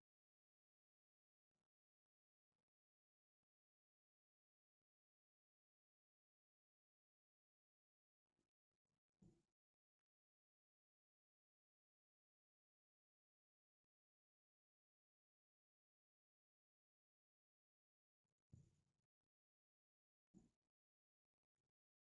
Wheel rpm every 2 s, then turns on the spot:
0, 0, 0, 0, 0, 0, 0, 0, 0, 0, 0.
none